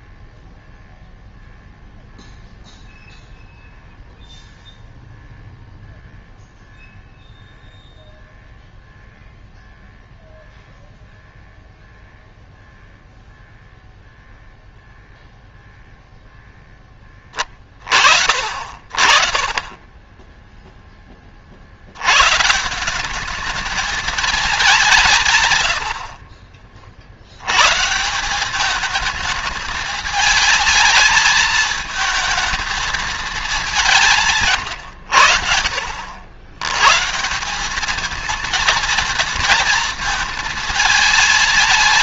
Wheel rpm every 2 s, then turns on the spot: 0, 0, 0, 0, 0, 0, 0, 0, 0, 50, 10, 130, 220, 60, 180, 220, 220, 150, 90, 230, 220.
20-22 26-28